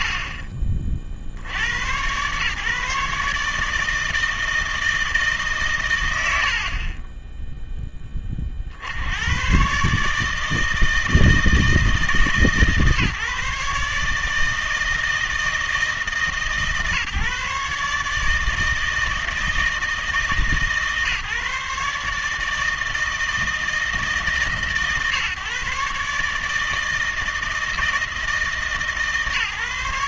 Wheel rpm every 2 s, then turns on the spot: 80, 120, 160, 100, 30, 160, 150, 160, 140, 160, 150, 160, 140, 160, 150.
none